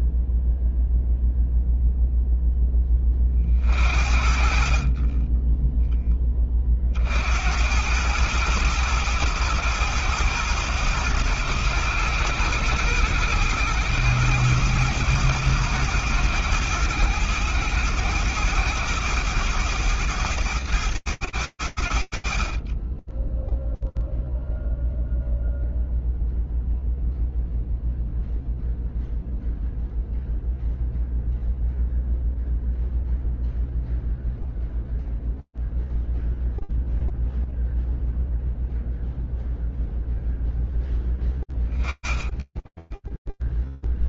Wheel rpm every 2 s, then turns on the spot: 0, 40, 20, 90, 100, 100, 100, 110, 110, 100, 100, 10, 0, 0, 0, 0, 0, 0, 0, 0, 10, 0.
none